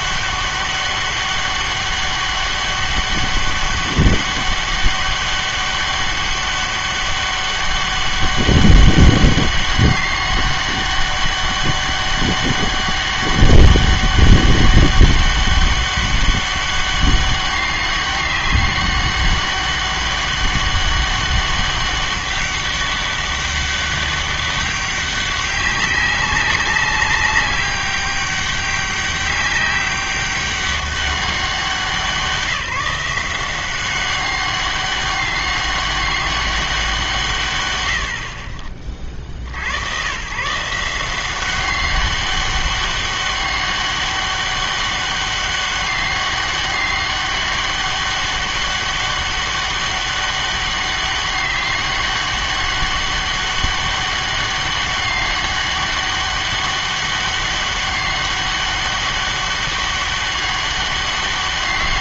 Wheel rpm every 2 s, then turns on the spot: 200, 200, 200, 200, 200, 200, 200, 200, 200, 200, 200, 200, 200, 190, 190, 200, 170, 200, 200, 50, 140, 200, 200, 200, 200, 200, 200, 200, 200, 200, 200.
none